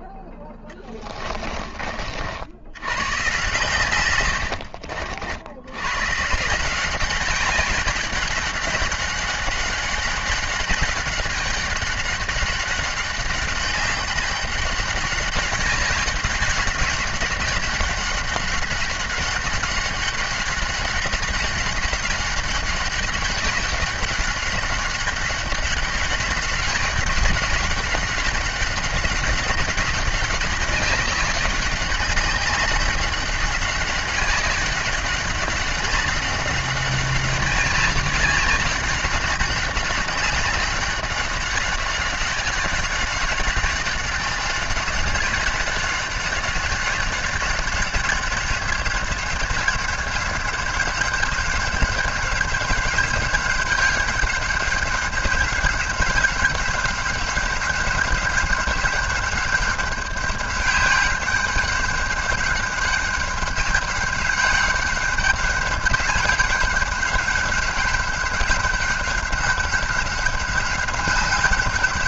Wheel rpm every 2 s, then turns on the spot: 10, 90, 60, 190, 200, 200, 200, 200, 190, 200, 200, 200, 200, 200, 200, 200, 190, 200, 190, 190, 200, 190, 200, 200, 200, 190, 200, 190, 190, 200, 200, 200, 190, 190, 200, 190.
0-2